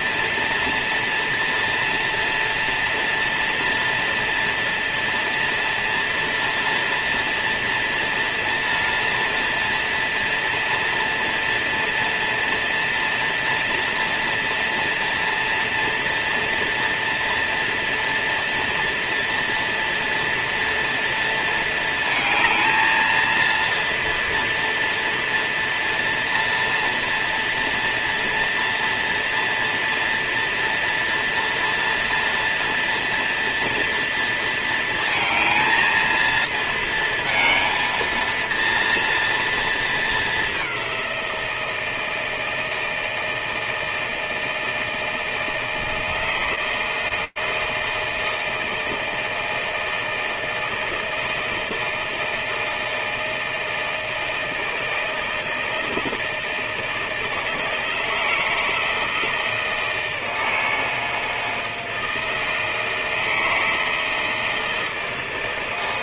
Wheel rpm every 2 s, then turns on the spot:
230, 230, 230, 230, 230, 230, 230, 230, 230, 230, 230, 220, 230, 230, 230, 240, 230, 220, 230, 230, 180, 160, 160, 160, 160, 160, 160, 160, 160, 160, 160, 160, 160.
none